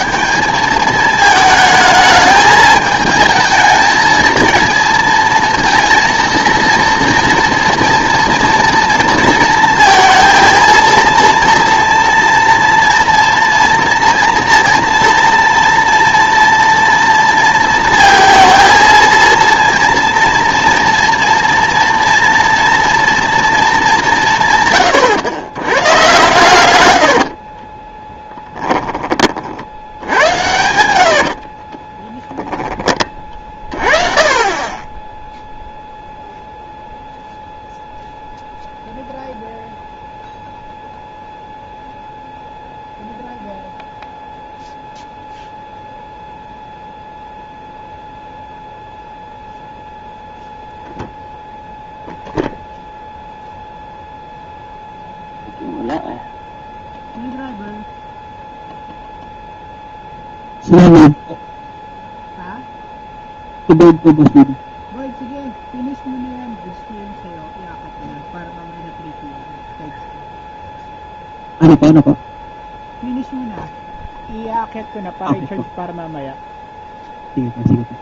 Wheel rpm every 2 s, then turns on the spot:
200, 210, 230, 230, 230, 230, 230, 230, 230, 230, 240, 230, 130, 110, 10, 80, 20, 30, 0, 0, 0, 0, 0, 0, 0, 0, 0, 0, 0, 0, 0, 0, 0, 0, 0, 0, 0, 0, 0.
26-32